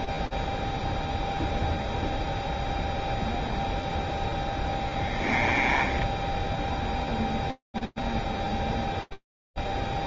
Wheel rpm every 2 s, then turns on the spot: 0, 10, 0, 0, 0.
2-4